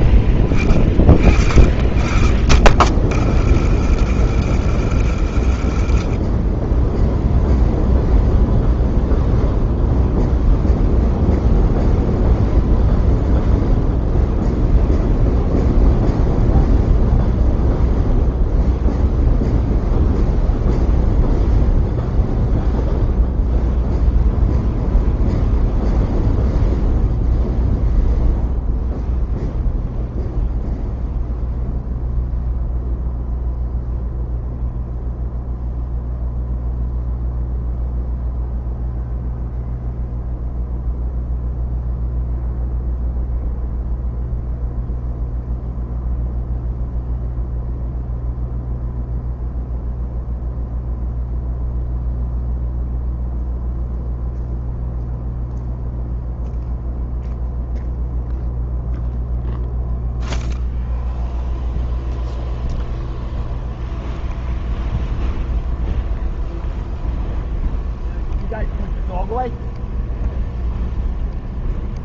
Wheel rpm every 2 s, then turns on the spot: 30, 50, 110, 40, 0, 0, 0, 0, 0, 0, 0, 0, 0, 0, 0, 0, 0, 0, 0, 0, 0, 0, 0, 0, 0, 0, 0, 0, 0, 0, 0, 0, 0, 0, 0, 0.
4-8